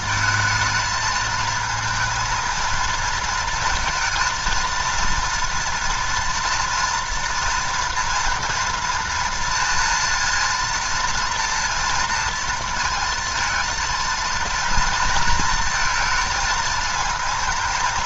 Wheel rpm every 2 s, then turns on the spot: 220, 230, 230, 230, 230, 230, 230, 230, 220.
none